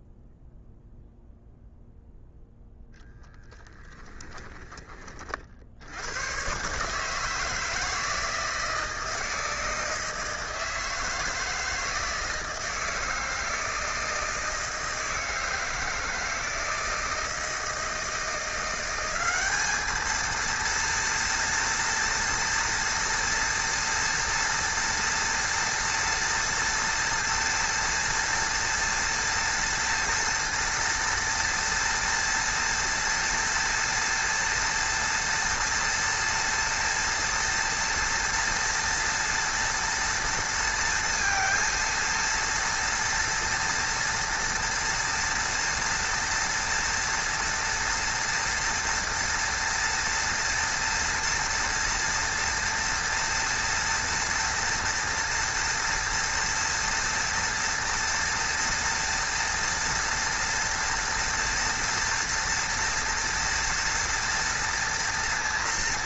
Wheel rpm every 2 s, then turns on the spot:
0, 0, 20, 130, 160, 160, 160, 160, 160, 180, 230, 230, 230, 230, 240, 230, 230, 230, 230, 230, 230, 230, 230, 230, 230, 230, 230, 230, 230, 230, 240, 230, 230.
none